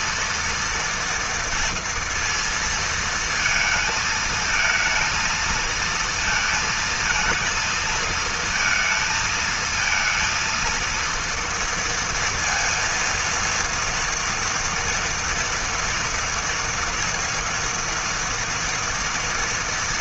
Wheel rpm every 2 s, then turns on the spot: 230, 220, 220, 230, 230, 230, 230, 230, 230, 230.
none